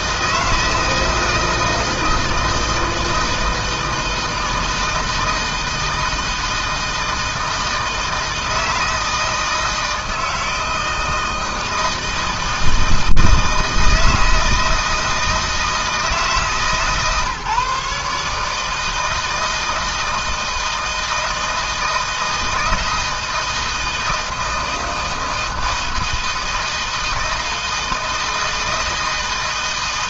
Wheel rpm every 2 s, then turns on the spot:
160, 160, 160, 160, 160, 160, 160, 160, 150, 160, 160, 160, 160, 160, 160.
none